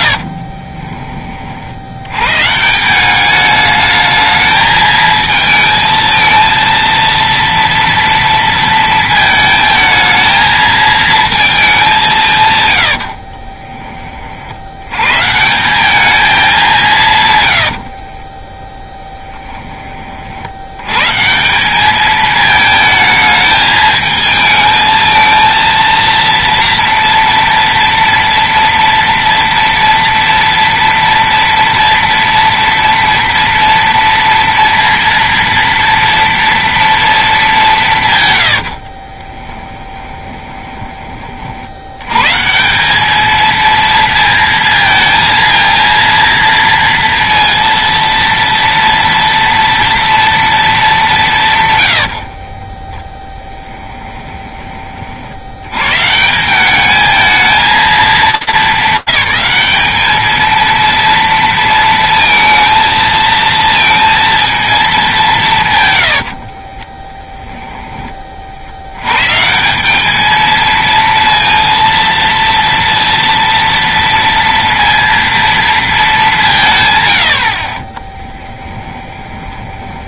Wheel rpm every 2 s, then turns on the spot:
40, 140, 220, 230, 230, 220, 110, 80, 190, 10, 80, 220, 220, 230, 230, 230, 230, 230, 230, 90, 20, 170, 230, 230, 230, 220, 30, 20, 180, 210, 230, 230, 230, 30, 80, 230, 230, 230, 150, 20.
0-2 18-20 38-42 52-54 66-68 78-80